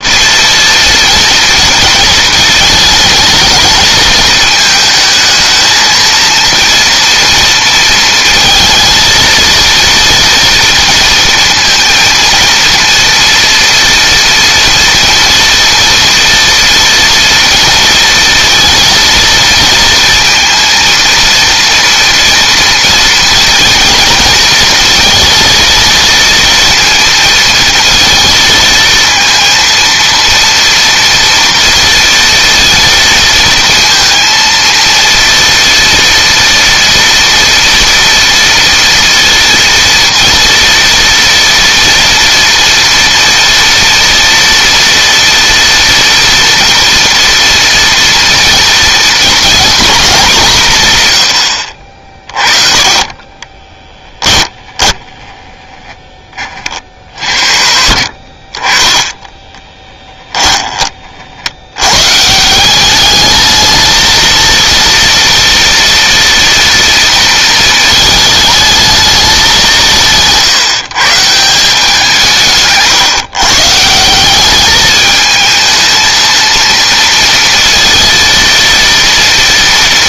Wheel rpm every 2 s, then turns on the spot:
230, 220, 220, 230, 220, 230, 230, 230, 230, 220, 230, 230, 230, 230, 230, 230, 230, 230, 230, 230, 230, 230, 230, 230, 240, 160, 30, 10, 50, 20, 30, 210, 230, 230, 210, 150, 140, 210, 230, 230.
54-56